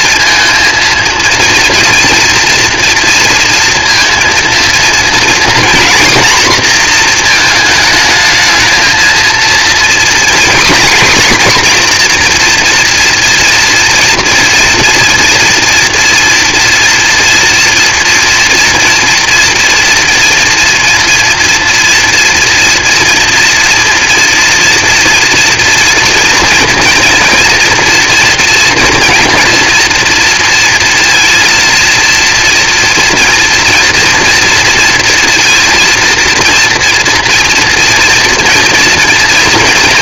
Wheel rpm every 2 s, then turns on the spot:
230, 230, 230, 240, 220, 240, 230, 230, 230, 230, 230, 230, 240, 230, 230, 230, 230, 230, 230, 230.
none